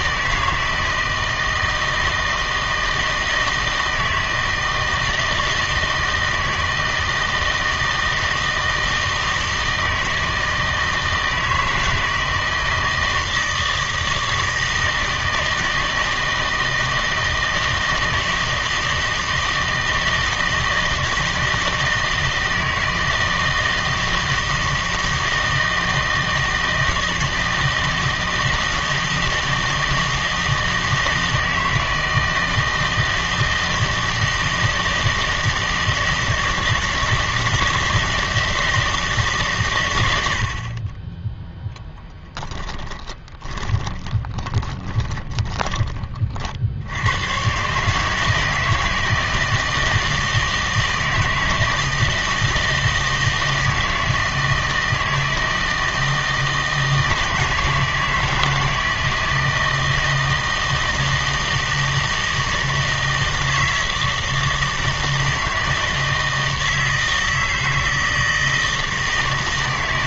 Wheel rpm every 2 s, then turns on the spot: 160, 160, 160, 160, 160, 160, 160, 160, 160, 160, 160, 160, 160, 160, 160, 160, 160, 160, 160, 160, 60, 10, 20, 60, 160, 160, 160, 160, 160, 160, 160, 160, 160, 160, 160.
42-46